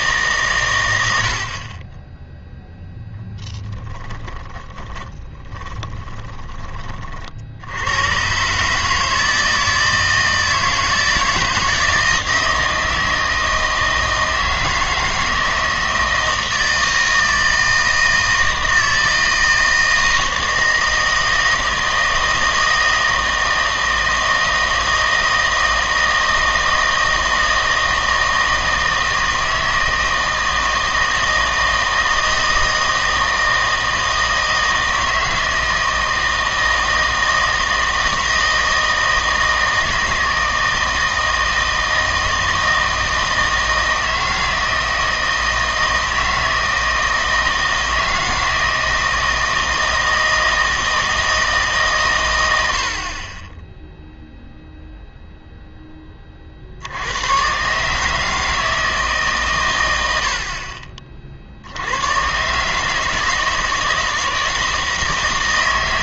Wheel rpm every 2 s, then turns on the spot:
130, 0, 10, 20, 140, 160, 160, 160, 160, 160, 160, 160, 160, 160, 160, 160, 160, 160, 160, 160, 160, 160, 160, 160, 160, 160, 90, 0, 60, 160, 40, 140, 160.
4-6